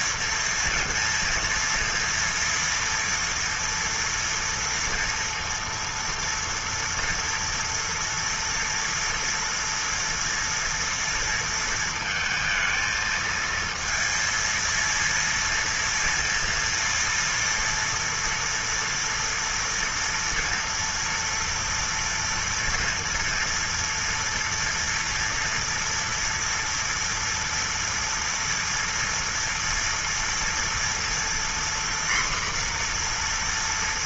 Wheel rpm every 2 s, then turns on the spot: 230, 230, 230, 230, 230, 230, 230, 230, 230, 230, 230, 230, 230, 230, 230, 230, 240.
none